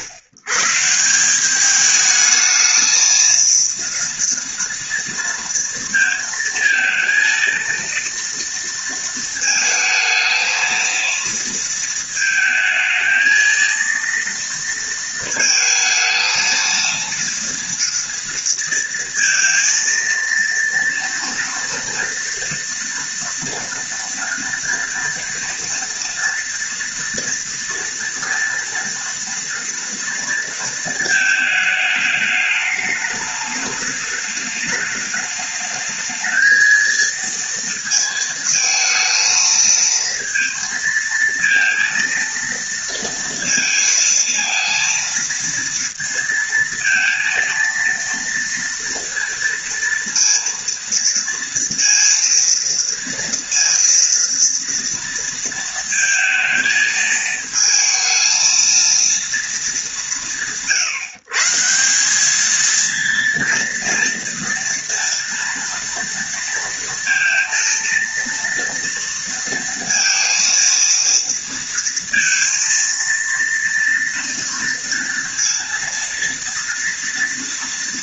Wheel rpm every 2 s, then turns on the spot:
130, 220, 230, 230, 230, 230, 220, 230, 230, 230, 230, 230, 230, 230, 230, 230, 210, 210, 220, 220, 230, 230, 230, 230, 230, 230, 230, 230, 230, 230, 140, 210, 230, 230, 230, 230, 230, 230, 230.
none